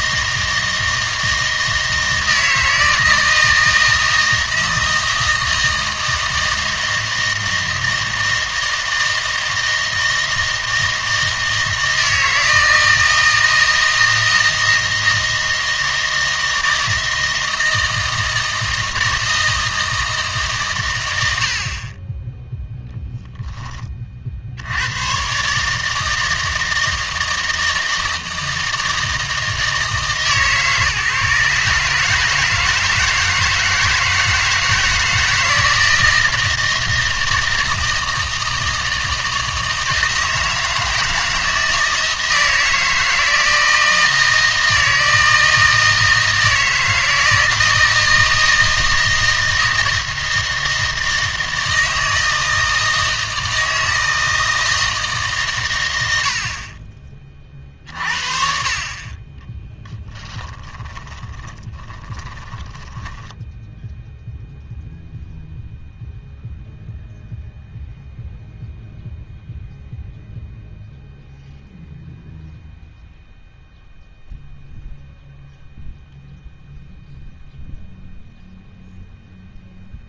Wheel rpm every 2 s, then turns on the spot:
160, 160, 160, 160, 160, 160, 160, 160, 160, 160, 130, 0, 70, 160, 160, 150, 160, 160, 160, 160, 160, 160, 160, 160, 160, 160, 160, 160, 60, 50, 20, 20, 0, 0, 0, 0, 0, 0, 0, 0.
60-64